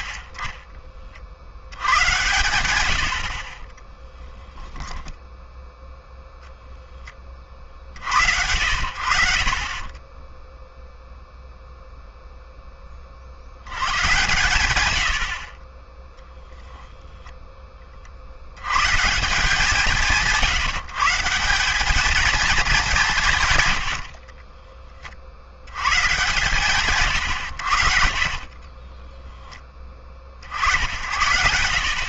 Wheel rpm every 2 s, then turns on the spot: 30, 110, 10, 0, 80, 0, 10, 120, 20, 90, 160, 210, 30, 140, 30, 60.
2-6 24-26 28-30